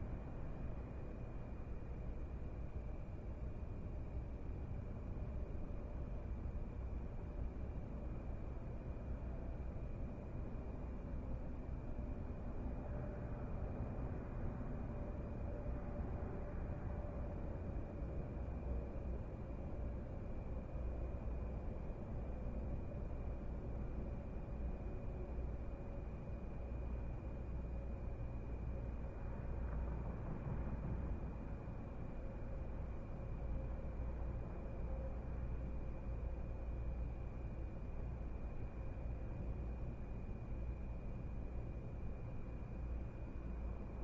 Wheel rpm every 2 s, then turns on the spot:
0, 0, 0, 0, 0, 0, 0, 0, 0, 0, 0, 0, 0, 0, 0, 0, 0, 0, 0, 0, 0, 0.
none